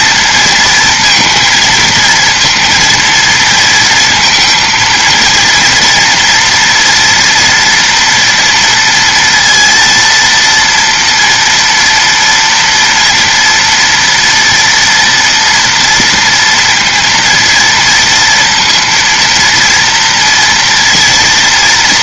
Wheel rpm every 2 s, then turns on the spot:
230, 230, 230, 230, 230, 230, 240, 230, 230, 230, 230.
none